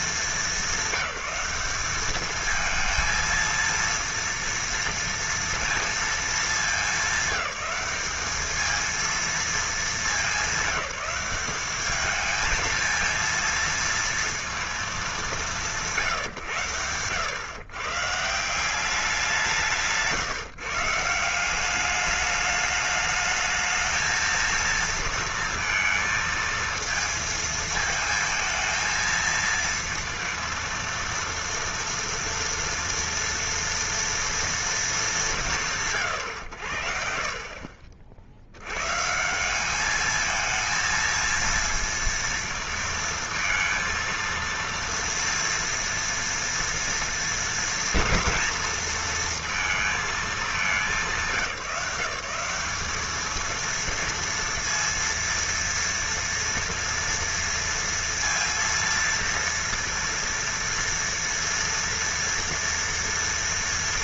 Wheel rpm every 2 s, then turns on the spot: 200, 220, 230, 210, 220, 200, 220, 220, 110, 180, 150, 210, 230, 220, 220, 230, 230, 230, 110, 100, 220, 230, 230, 230, 230, 210, 200, 230, 230, 230, 230, 230.
none